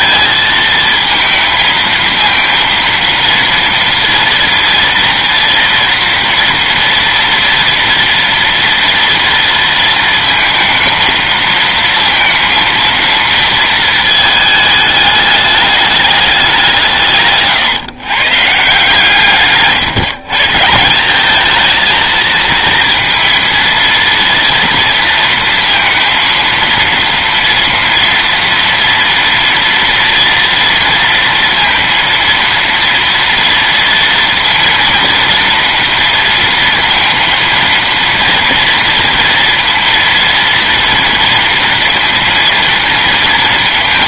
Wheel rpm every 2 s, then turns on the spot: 230, 230, 230, 240, 240, 230, 230, 220, 180, 150, 160, 230, 230, 230, 230, 230, 230, 230, 230, 230, 230, 240.
none